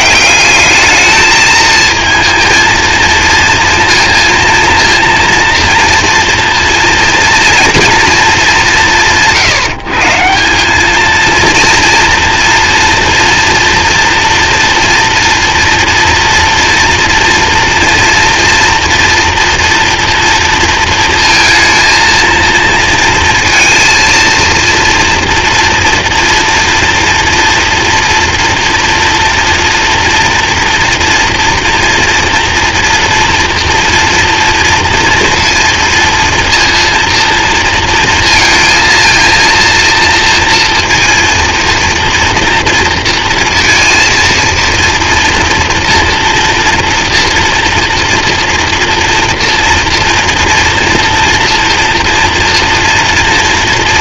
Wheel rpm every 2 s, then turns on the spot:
200, 230, 230, 230, 200, 190, 230, 230, 230, 230, 230, 230, 230, 230, 230, 230, 230, 230, 230, 230, 230, 230, 230, 240, 230, 230, 230.
none